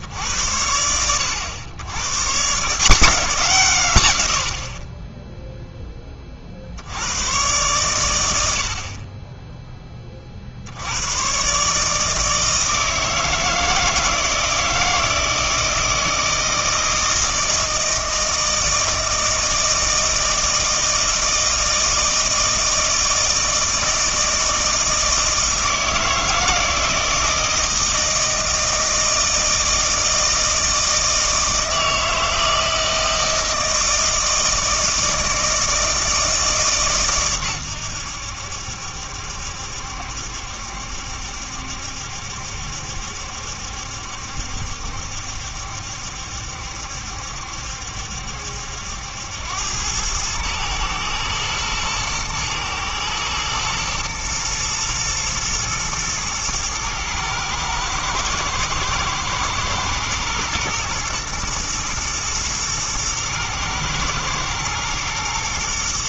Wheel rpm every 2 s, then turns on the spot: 80, 160, 40, 80, 50, 80, 160, 160, 160, 160, 160, 160, 160, 160, 160, 160, 160, 160, 140, 70, 70, 70, 70, 70, 80, 110, 120, 120, 110, 120, 120, 110, 110.
none